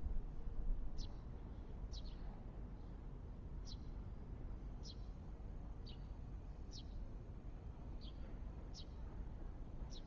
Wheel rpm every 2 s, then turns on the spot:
0, 0, 0, 0, 0.
none